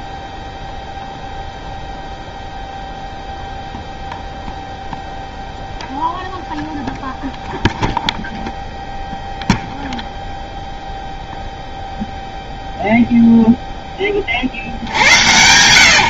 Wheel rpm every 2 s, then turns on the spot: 0, 0, 0, 0, 0, 0, 0, 80.
none